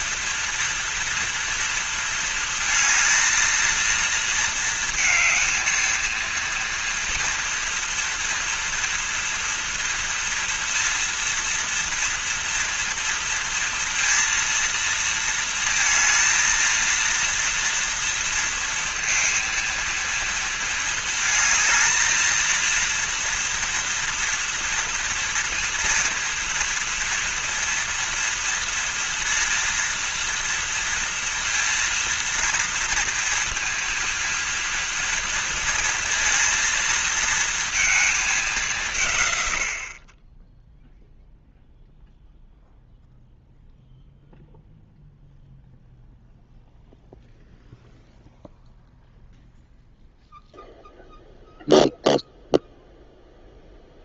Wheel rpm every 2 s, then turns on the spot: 230, 230, 220, 230, 230, 230, 230, 230, 230, 230, 220, 230, 230, 230, 230, 230, 230, 230, 230, 150, 0, 0, 0, 0, 0, 0, 0.
none